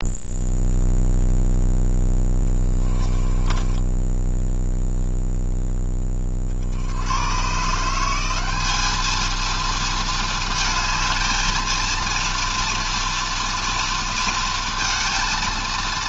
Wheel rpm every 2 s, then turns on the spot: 0, 10, 0, 90, 210, 220, 240, 230.
2-4